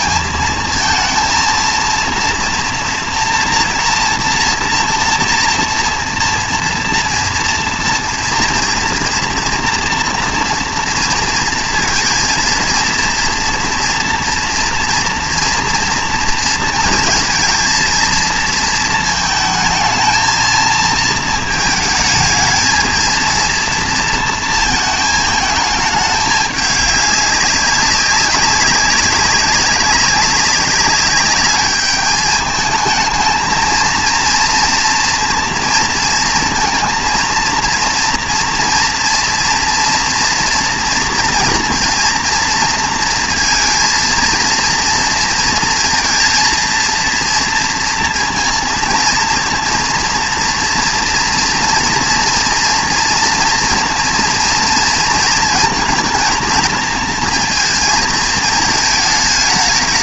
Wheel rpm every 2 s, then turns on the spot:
220, 230, 230, 230, 230, 230, 230, 230, 230, 220, 220, 220, 230, 200, 190, 200, 220, 230, 230, 230, 240, 230, 230, 230, 230, 230, 230, 230, 230, 220.
none